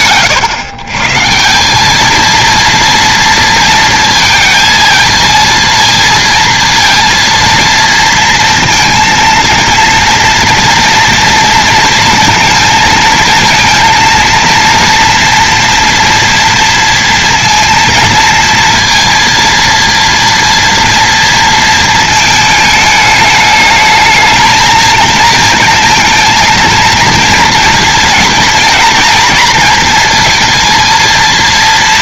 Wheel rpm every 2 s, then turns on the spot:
130, 230, 230, 230, 230, 230, 220, 230, 230, 230, 230, 210, 230, 230, 230, 230.
none